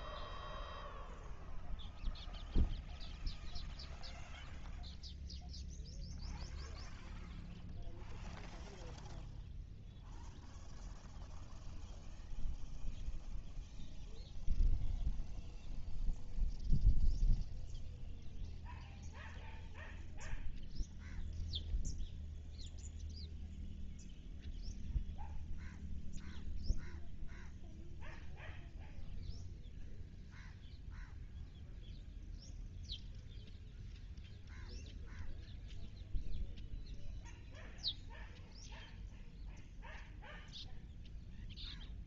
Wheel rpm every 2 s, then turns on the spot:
0, 0, 0, 0, 0, 0, 0, 0, 0, 0, 0, 0, 0, 0, 0, 0, 0, 0, 0, 0, 0.
none